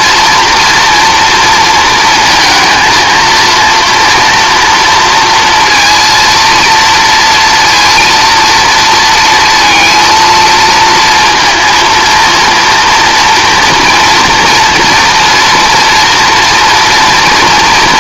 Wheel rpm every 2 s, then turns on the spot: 240, 230, 230, 230, 230, 220, 230, 240, 230.
none